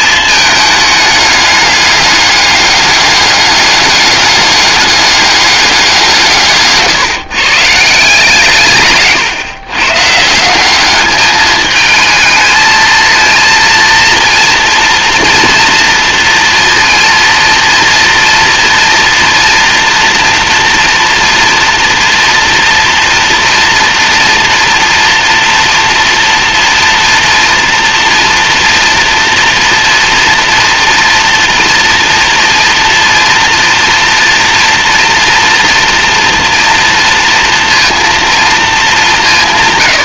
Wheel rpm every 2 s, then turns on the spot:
210, 200, 200, 150, 140, 200, 220, 230, 230, 230, 230, 230, 230, 240, 240, 230, 230, 230, 230, 210.
none